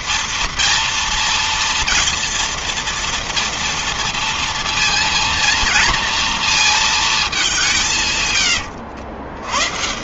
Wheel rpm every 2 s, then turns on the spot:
230, 240, 230, 220, 100.
none